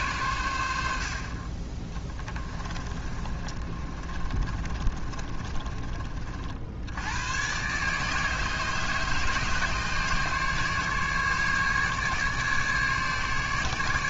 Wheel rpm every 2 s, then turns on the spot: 80, 20, 30, 80, 150, 150, 150.
2-6